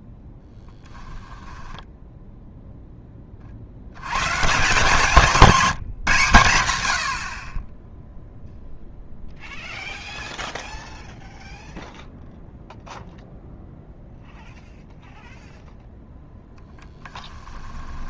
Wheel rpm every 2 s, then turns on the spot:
10, 0, 160, 120, 0, 0, 0, 0, 10.
0-2 16-18